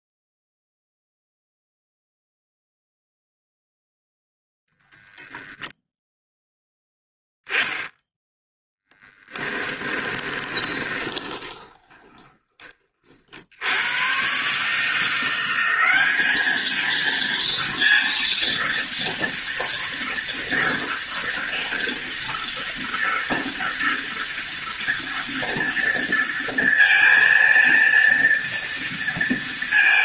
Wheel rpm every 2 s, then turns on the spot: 0, 0, 0, 0, 10, 20, 30, 150, 220, 230, 230, 230, 230, 230, 230.
10-12